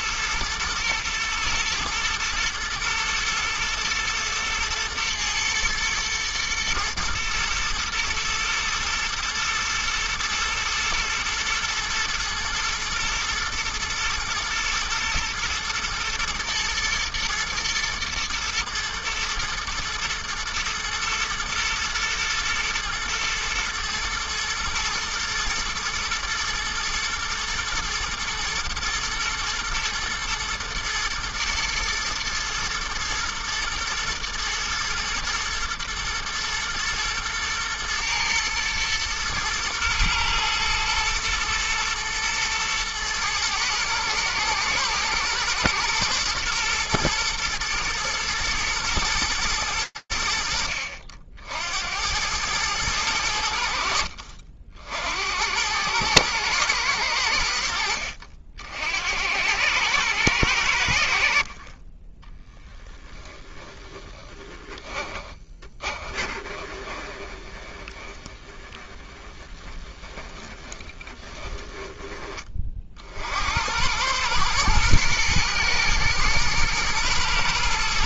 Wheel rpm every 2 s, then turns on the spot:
120, 110, 110, 120, 110, 110, 110, 120, 110, 120, 120, 120, 110, 120, 110, 120, 110, 120, 120, 110, 110, 110, 120, 120, 110, 70, 100, 60, 100, 70, 80, 10, 20, 20, 10, 20, 60, 120, 110.
64-72